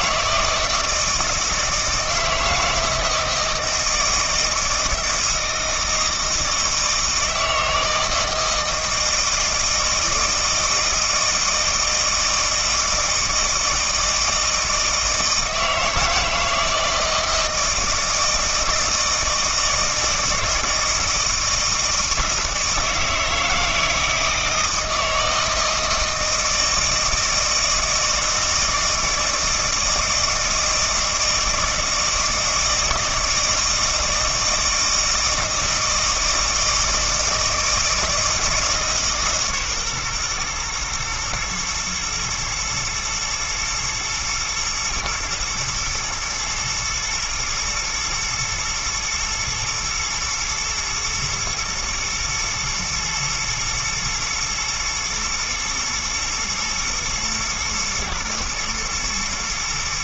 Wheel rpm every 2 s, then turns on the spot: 160, 160, 160, 160, 160, 160, 160, 160, 160, 160, 160, 160, 160, 160, 160, 160, 160, 160, 160, 150, 110, 110, 120, 110, 120, 110, 120, 110, 110, 110.
none